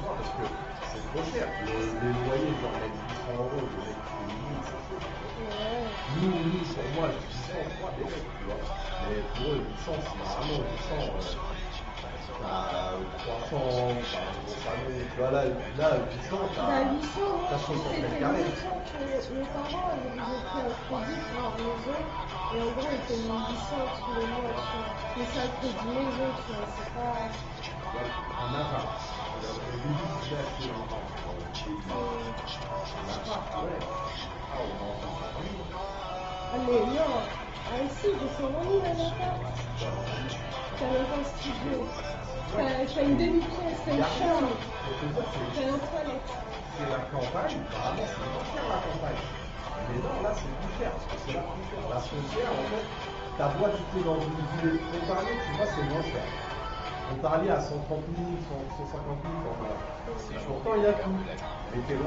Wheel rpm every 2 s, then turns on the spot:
0, 0, 0, 0, 0, 0, 0, 0, 0, 0, 0, 0, 0, 0, 0, 0, 0, 0, 0, 0, 0, 0, 0, 0, 0, 0, 0, 0, 0, 0, 0.
none